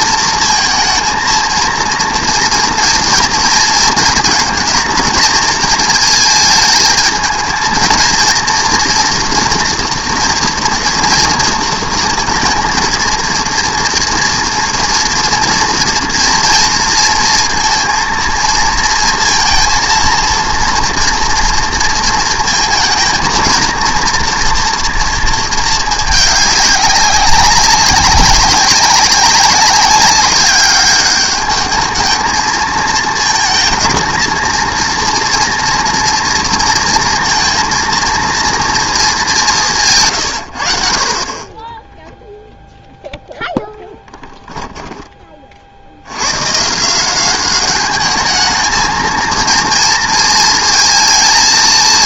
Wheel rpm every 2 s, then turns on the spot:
230, 230, 220, 220, 230, 230, 230, 230, 230, 230, 230, 220, 230, 200, 190, 200, 220, 230, 230, 230, 70, 0, 10, 140, 220, 220.
44-46